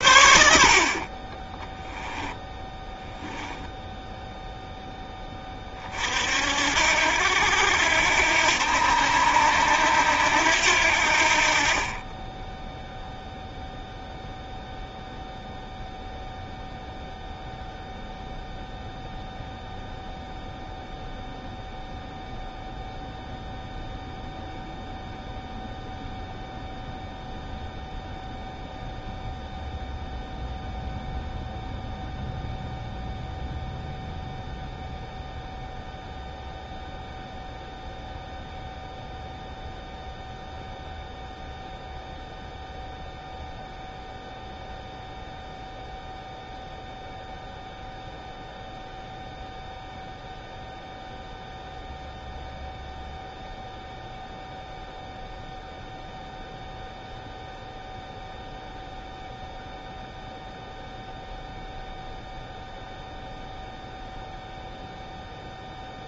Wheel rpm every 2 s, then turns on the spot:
50, 10, 0, 70, 80, 70, 0, 0, 0, 0, 0, 0, 0, 0, 0, 0, 0, 0, 0, 0, 0, 0, 0, 0, 0, 0, 0, 0, 0, 0, 0, 0, 0.
2-4